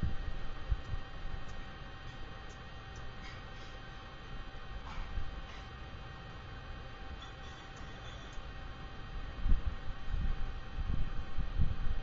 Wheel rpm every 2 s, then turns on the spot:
0, 0, 0, 0, 0, 0.
none